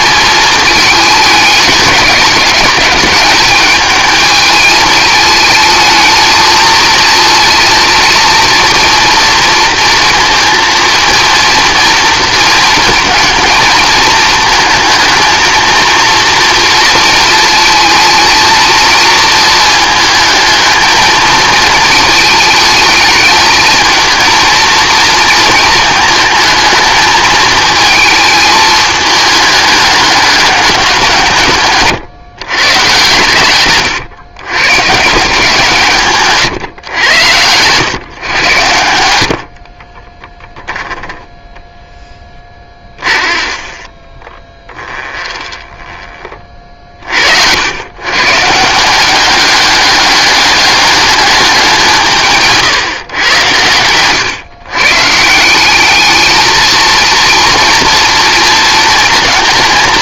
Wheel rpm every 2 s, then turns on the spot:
220, 200, 220, 220, 230, 230, 230, 220, 230, 220, 220, 220, 230, 220, 220, 190, 120, 120, 130, 100, 10, 20, 20, 40, 160, 200, 140, 130, 220, 230.
42-48